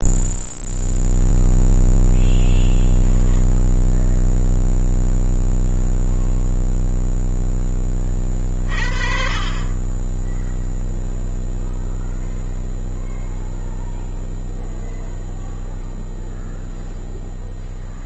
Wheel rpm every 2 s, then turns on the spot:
0, 10, 0, 0, 30, 10, 0, 0, 0.
none